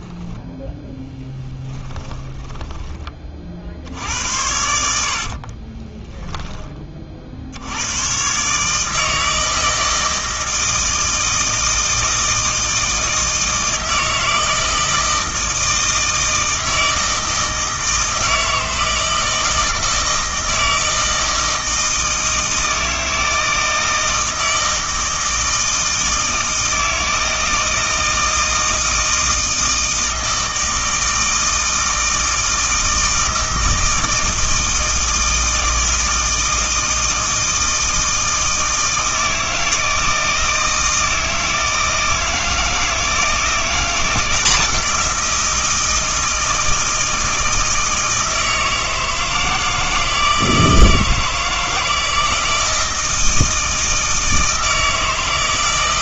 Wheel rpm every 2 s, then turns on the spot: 10, 20, 80, 20, 150, 160, 160, 160, 160, 160, 160, 160, 160, 160, 160, 160, 160, 160, 160, 160, 160, 160, 180, 160, 160, 160, 160, 160.
4-6